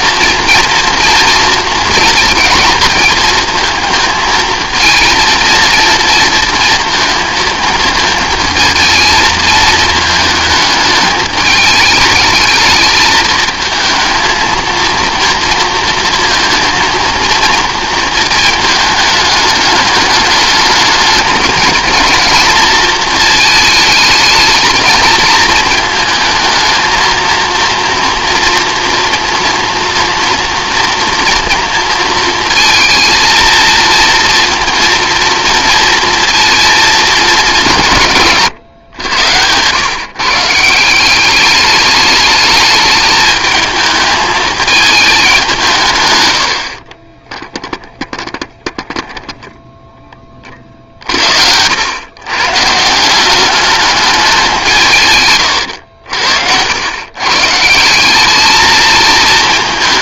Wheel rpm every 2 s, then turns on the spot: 230, 230, 220, 230, 220, 210, 220, 230, 230, 220, 210, 220, 220, 220, 230, 230, 230, 230, 230, 130, 160, 210, 210, 50, 10, 40, 150, 160, 100, 220.
46-50